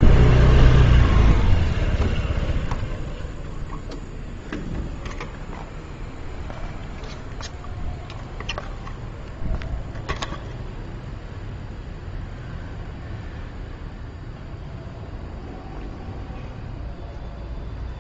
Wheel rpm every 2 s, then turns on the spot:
0, 0, 0, 0, 0, 0, 0, 0, 0.
none